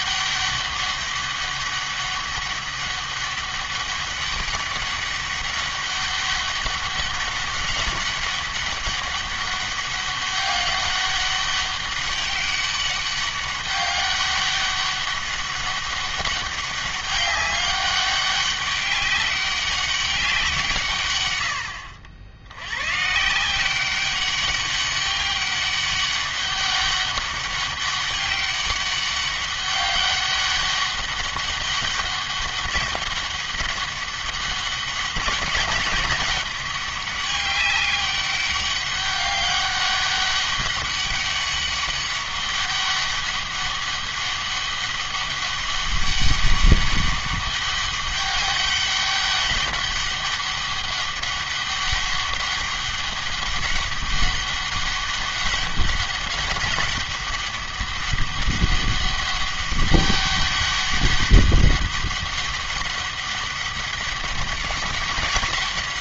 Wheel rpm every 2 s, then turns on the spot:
200, 200, 200, 200, 200, 200, 200, 200, 200, 200, 160, 110, 200, 200, 200, 200, 200, 200, 200, 200, 200, 200, 200, 200, 200, 200, 200, 200, 190, 200, 200, 200, 200.
none